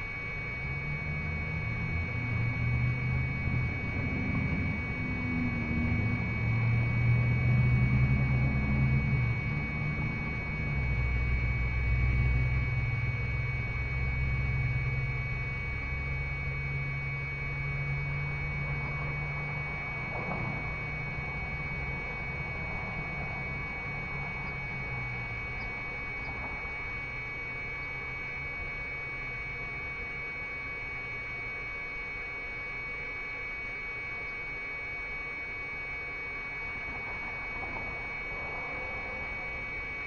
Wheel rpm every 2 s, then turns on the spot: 0, 0, 0, 0, 0, 0, 0, 0, 0, 0, 0, 0, 0, 0, 0, 0, 0, 0, 0, 0.
none